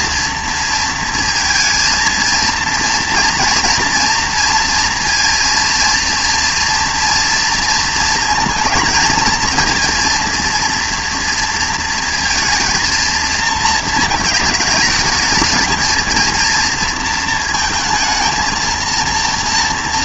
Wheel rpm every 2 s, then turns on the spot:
230, 230, 230, 240, 220, 230, 230, 220, 230, 230.
none